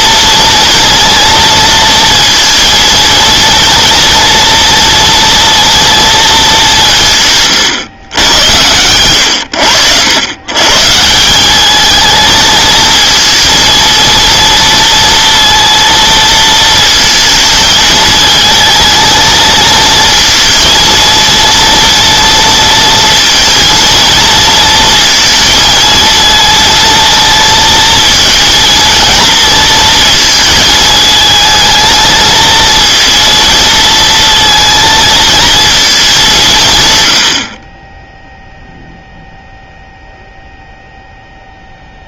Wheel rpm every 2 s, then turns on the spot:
230, 230, 230, 200, 120, 120, 220, 230, 220, 220, 230, 230, 230, 220, 230, 220, 230, 220, 160, 0, 0.
none